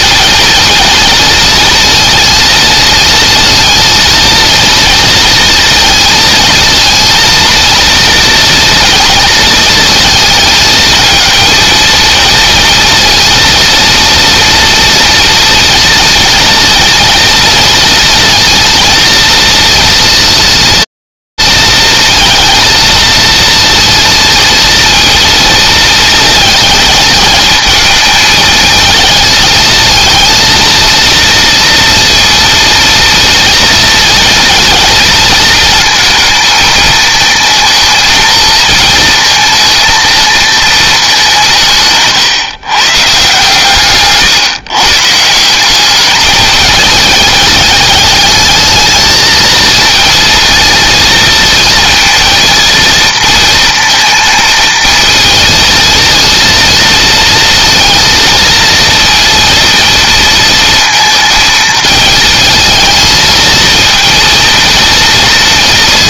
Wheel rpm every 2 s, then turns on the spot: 230, 230, 230, 230, 230, 220, 230, 230, 230, 230, 230, 230, 230, 220, 220, 230, 230, 230, 220, 230, 190, 140, 150, 220, 220, 230, 230, 230, 230, 230, 230, 220, 230.
none